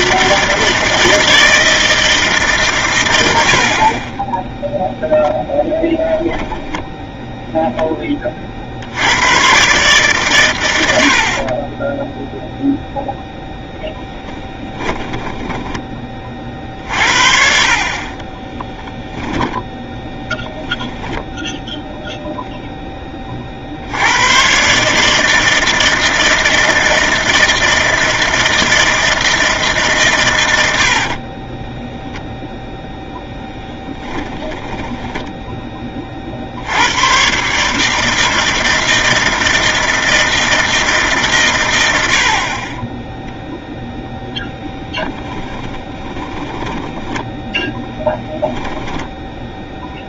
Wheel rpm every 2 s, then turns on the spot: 160, 140, 0, 0, 60, 70, 0, 20, 50, 10, 0, 10, 140, 160, 160, 70, 0, 10, 100, 160, 160, 20, 0, 10, 10.
14-16 18-20 34-36 46-48